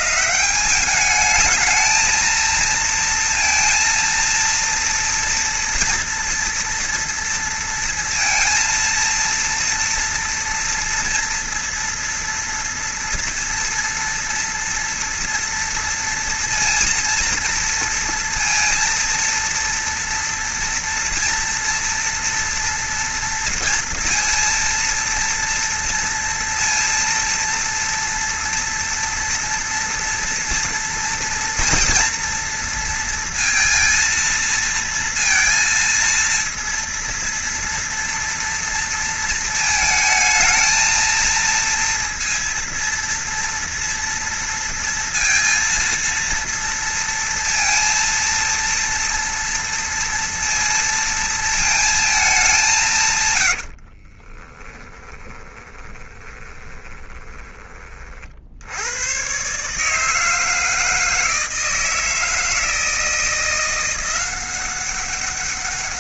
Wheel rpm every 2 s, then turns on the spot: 160, 230, 230, 230, 230, 230, 230, 230, 230, 230, 230, 240, 230, 230, 230, 240, 230, 230, 230, 230, 220, 230, 230, 230, 230, 230, 200, 20, 20, 60, 160, 160, 180.
54-58